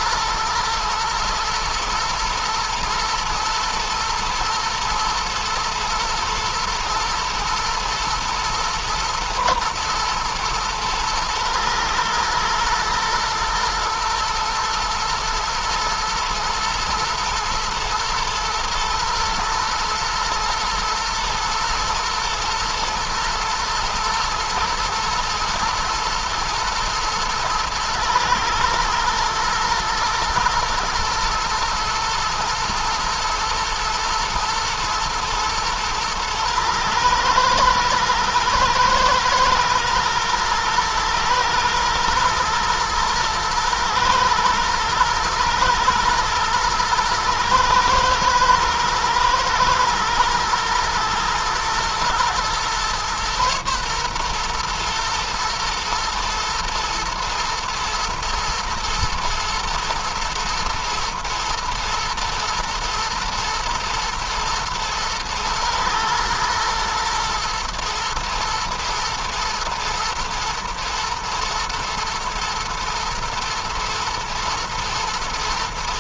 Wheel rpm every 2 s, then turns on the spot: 120, 110, 120, 120, 120, 110, 120, 120, 120, 110, 110, 110, 110, 110, 110, 110, 110, 110, 120, 110, 110, 110, 110, 110, 110, 110, 120, 120, 120, 120, 120, 120, 120, 110, 110, 110, 120, 110.
none